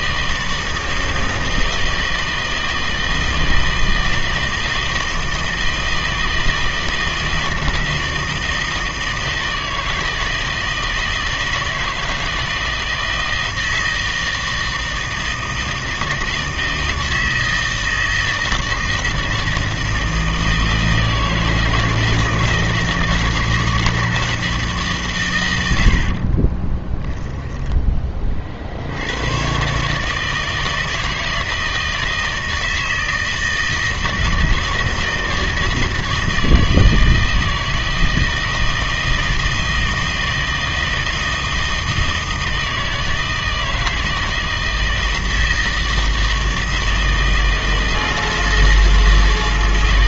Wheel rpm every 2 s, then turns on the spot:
160, 160, 160, 160, 160, 160, 160, 160, 160, 160, 160, 160, 160, 20, 60, 160, 160, 160, 160, 160, 160, 160, 160, 160, 160.
26-28